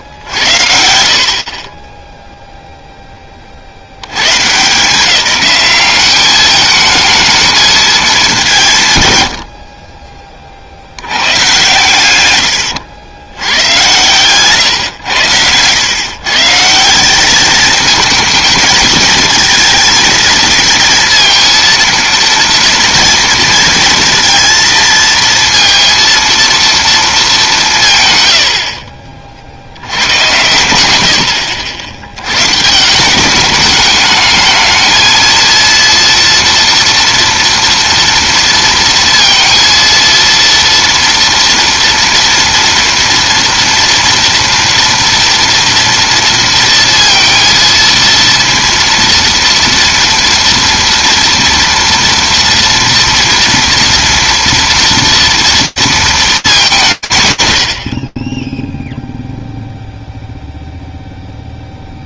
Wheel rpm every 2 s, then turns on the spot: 70, 0, 170, 210, 150, 80, 100, 110, 180, 230, 220, 230, 230, 230, 60, 80, 180, 230, 230, 230, 230, 230, 240, 230, 230, 230, 230, 230, 130, 0, 0.
30-32